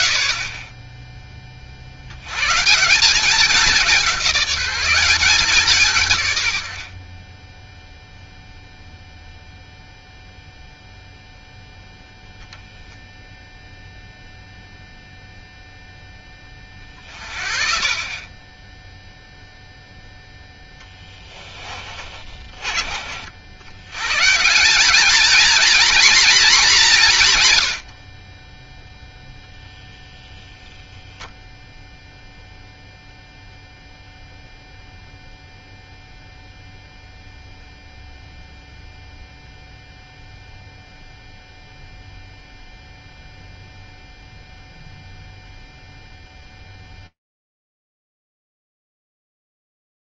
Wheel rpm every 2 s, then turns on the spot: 40, 130, 190, 90, 0, 0, 0, 0, 30, 20, 0, 40, 180, 230, 20, 0, 0, 0, 0, 0, 0, 0, 0, 0, 0.
none